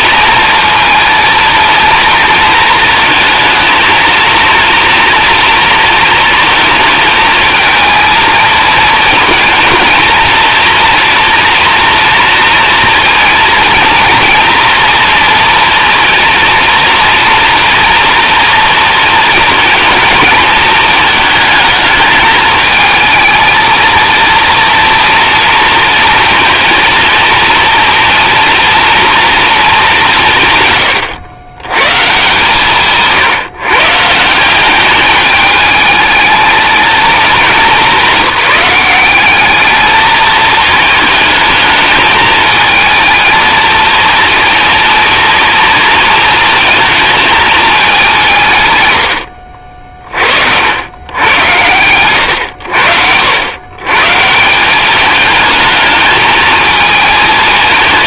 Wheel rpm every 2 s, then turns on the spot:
230, 220, 230, 220, 220, 230, 230, 230, 230, 230, 220, 220, 230, 230, 230, 140, 150, 200, 220, 190, 220, 220, 230, 220, 120, 90, 80, 190, 220.
none